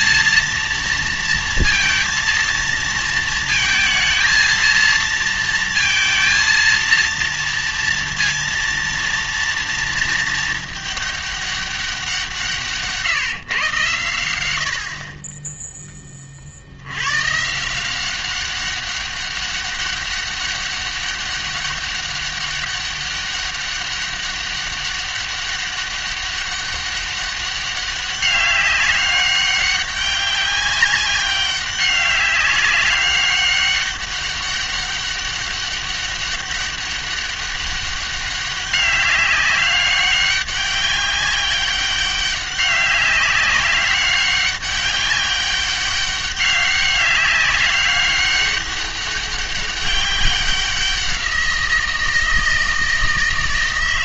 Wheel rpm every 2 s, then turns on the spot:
230, 230, 230, 230, 230, 210, 160, 70, 70, 200, 200, 200, 200, 200, 200, 200, 200, 200, 200, 190, 200, 190, 200, 200, 200, 190, 160.
none